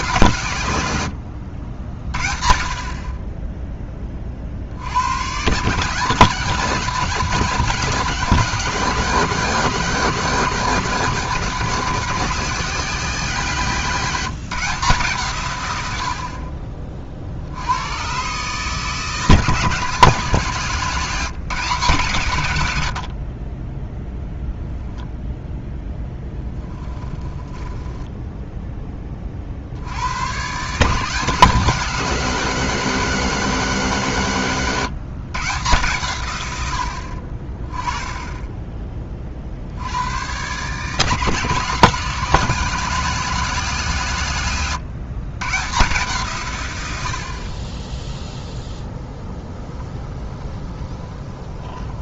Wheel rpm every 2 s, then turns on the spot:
110, 30, 70, 180, 190, 190, 180, 160, 40, 160, 170, 80, 10, 10, 10, 150, 190, 140, 80, 20, 150, 210, 130, 100, 0, 20.
20-22 26-28 50-52